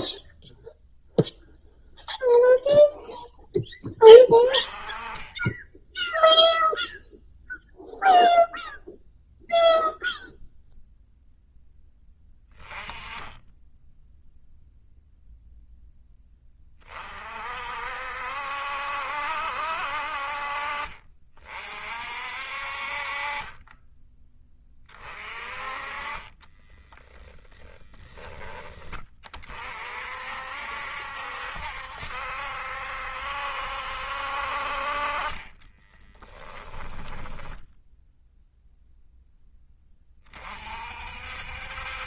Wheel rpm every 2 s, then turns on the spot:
0, 0, 20, 0, 0, 0, 10, 0, 30, 70, 50, 50, 20, 10, 30, 60, 70, 40, 10, 0, 50.
26-28 36-38